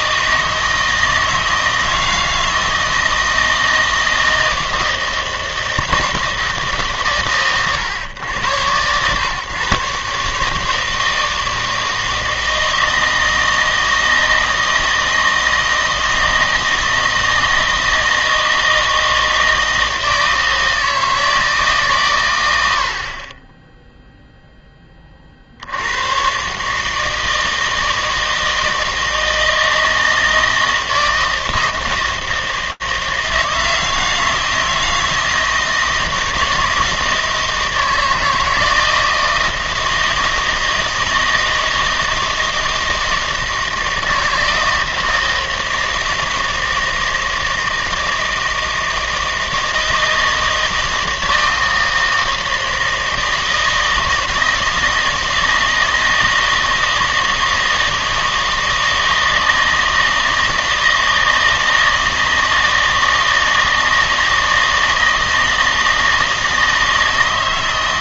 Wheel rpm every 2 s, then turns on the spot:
160, 160, 160, 150, 110, 160, 160, 160, 160, 160, 160, 80, 20, 150, 160, 160, 160, 160, 160, 160, 160, 160, 160, 160, 160, 160, 160, 160, 160, 160, 160, 160, 160, 160.
none